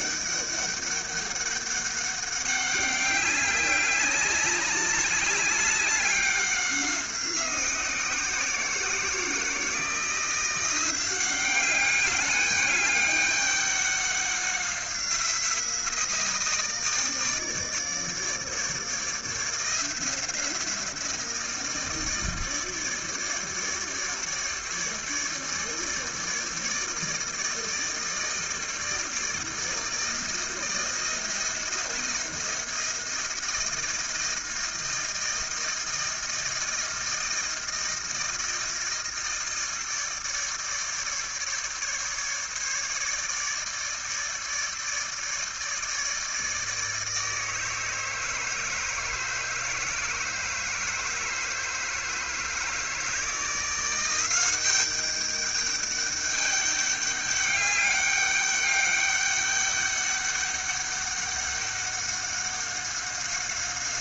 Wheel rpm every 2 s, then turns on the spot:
200, 200, 200, 190, 170, 180, 200, 190, 160, 160, 170, 160, 150, 160, 160, 160, 170, 160, 160, 160, 150, 150, 150, 160, 160, 160, 160, 190, 200, 200, 200, 190.
none